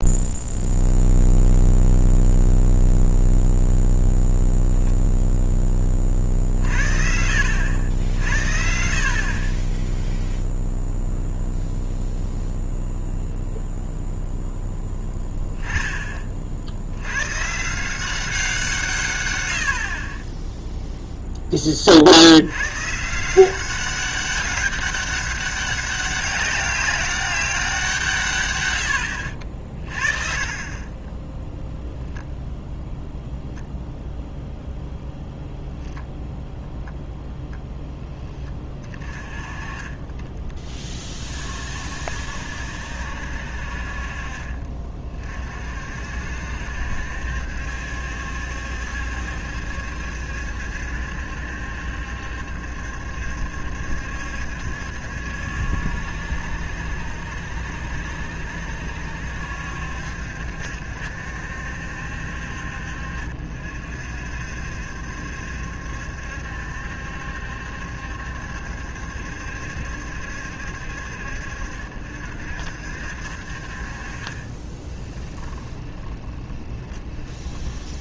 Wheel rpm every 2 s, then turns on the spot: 0, 0, 0, 60, 60, 0, 0, 10, 100, 160, 0, 140, 200, 200, 80, 30, 0, 0, 0, 40, 30, 60, 40, 70, 70, 70, 70, 70, 70, 70, 70, 60, 70, 70, 70, 60, 60, 20, 10.
14-16 28-30 74-78